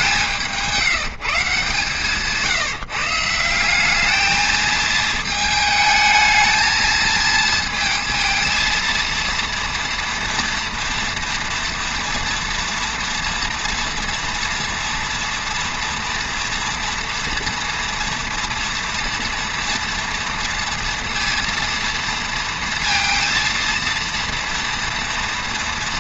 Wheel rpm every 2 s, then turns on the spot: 170, 160, 220, 220, 230, 240, 230, 230, 230, 230, 230, 230, 230.
none